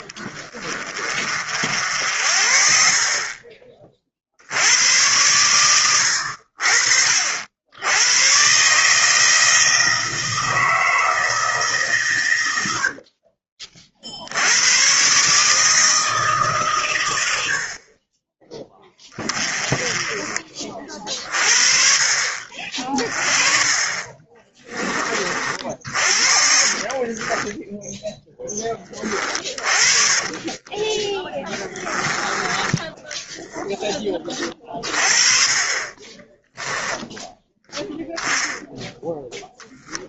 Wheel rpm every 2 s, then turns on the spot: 20, 60, 80, 60, 130, 160, 80, 100, 130, 20, 30, 40, 30, 40, 20, 30, 10, 30, 10, 0.
26-28 30-32 36-38